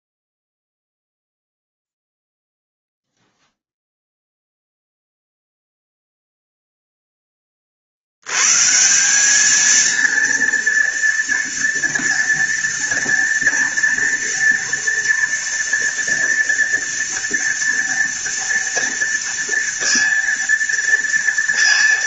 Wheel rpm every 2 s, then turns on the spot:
0, 0, 0, 10, 190, 230, 230, 230, 230, 230, 230.
none